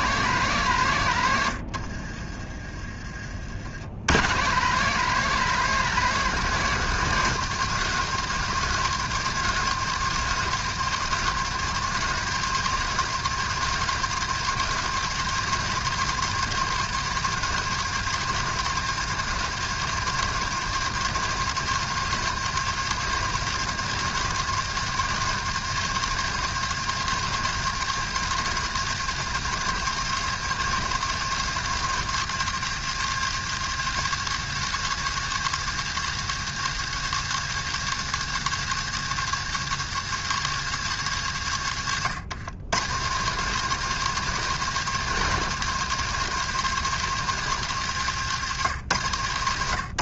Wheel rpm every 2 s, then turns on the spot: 170, 30, 140, 170, 180, 180, 170, 170, 180, 170, 170, 170, 170, 170, 170, 170, 150, 150, 150, 150, 150, 110, 180, 170, 130.
2-4